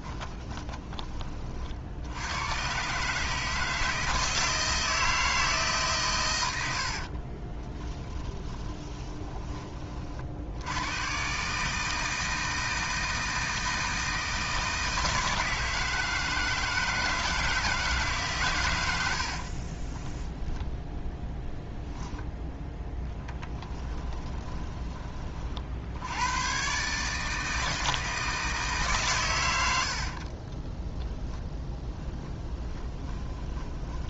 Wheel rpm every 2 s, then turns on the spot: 20, 130, 160, 60, 20, 100, 160, 160, 160, 100, 10, 10, 40, 140, 140, 20, 10.
0-2 6-10 30-34